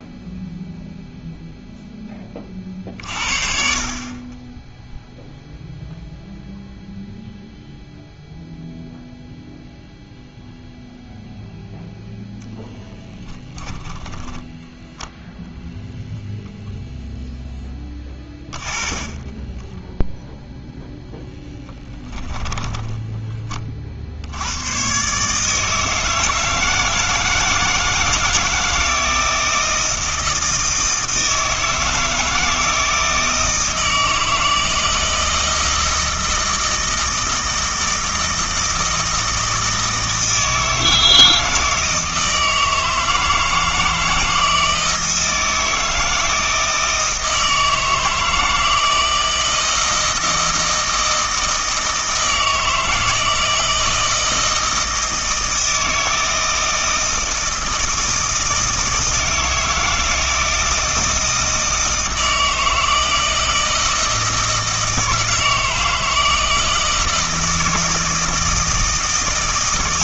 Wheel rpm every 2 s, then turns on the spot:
0, 40, 10, 0, 0, 0, 0, 10, 0, 30, 0, 10, 110, 160, 160, 160, 160, 160, 160, 160, 160, 160, 160, 160, 160, 160, 160, 160, 160, 160, 160, 160, 160, 160, 160.
14-16 18-20 22-24